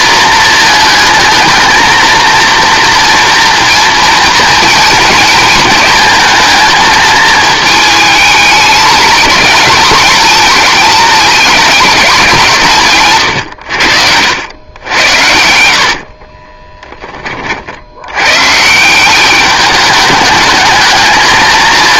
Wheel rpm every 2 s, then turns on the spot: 220, 230, 230, 220, 220, 230, 150, 100, 20, 160, 210.
16-18